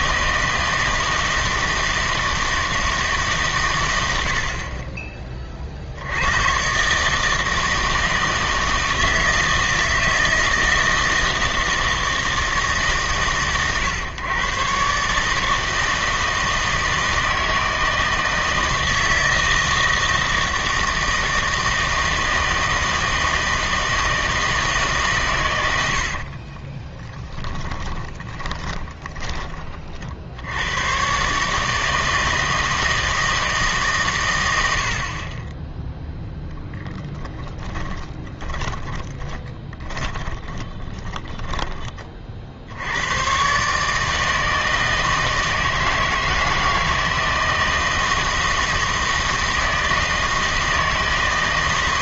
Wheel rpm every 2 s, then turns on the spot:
160, 160, 40, 130, 160, 160, 150, 130, 160, 160, 160, 160, 150, 20, 20, 100, 160, 80, 10, 30, 20, 70, 160, 160, 160, 160.
26-30 38-42